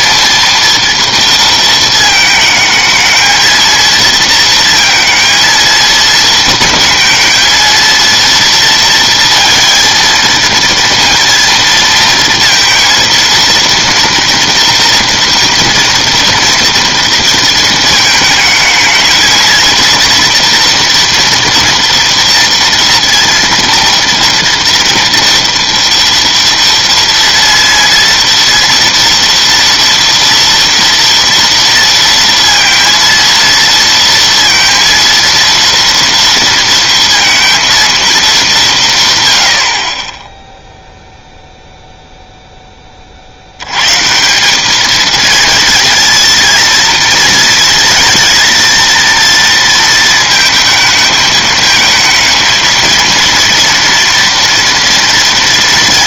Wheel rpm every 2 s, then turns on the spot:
230, 220, 220, 220, 230, 230, 230, 230, 230, 230, 240, 230, 230, 230, 230, 230, 230, 230, 230, 100, 0, 40, 220, 230, 230, 220, 230, 230.
none